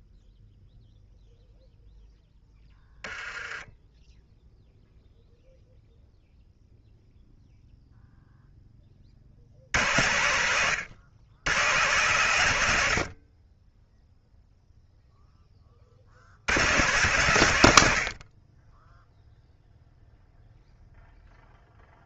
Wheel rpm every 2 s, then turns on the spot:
0, 20, 0, 0, 30, 110, 90, 0, 120, 20, 0.
2-4